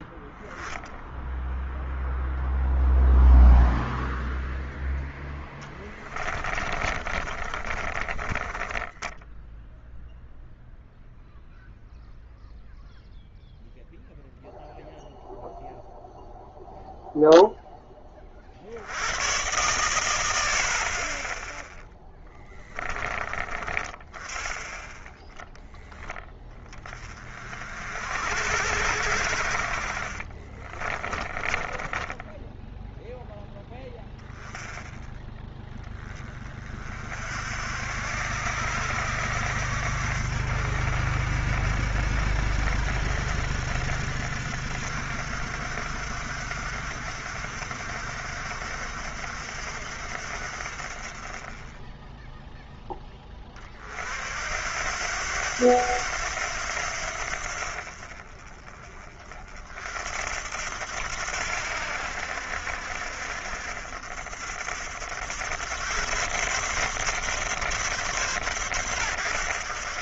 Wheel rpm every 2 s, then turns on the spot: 0, 0, 10, 30, 10, 0, 0, 0, 0, 70, 60, 20, 10, 20, 70, 30, 0, 10, 40, 70, 60, 60, 60, 60, 60, 40, 10, 80, 80, 30, 80, 70, 70, 130, 110.
4-10 22-24 30-32